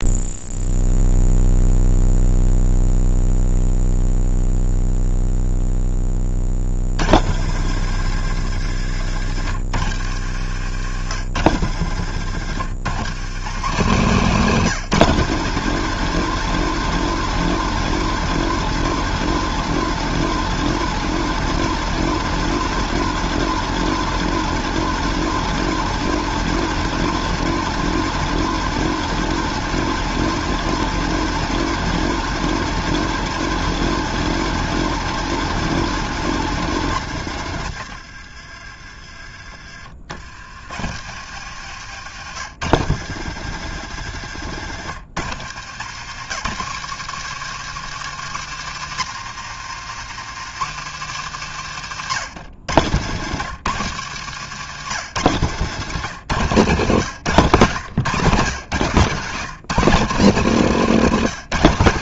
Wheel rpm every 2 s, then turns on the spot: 0, 0, 0, 100, 100, 100, 150, 190, 220, 220, 220, 220, 220, 220, 220, 210, 220, 220, 130, 40, 90, 120, 100, 150, 140, 130, 140, 140, 120, 150, 170.
54-56